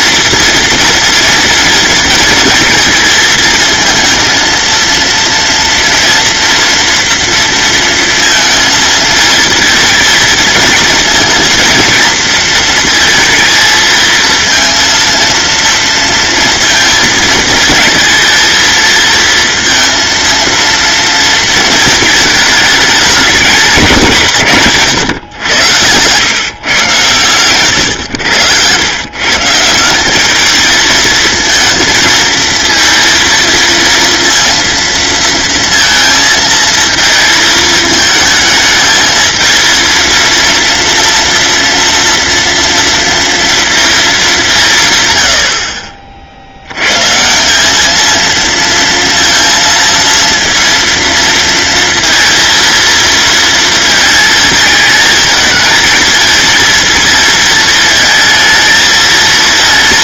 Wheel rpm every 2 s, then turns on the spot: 240, 220, 230, 230, 220, 230, 220, 230, 220, 230, 230, 210, 130, 140, 120, 220, 230, 230, 220, 220, 230, 230, 130, 130, 230, 230, 230, 220, 230, 220.
24-26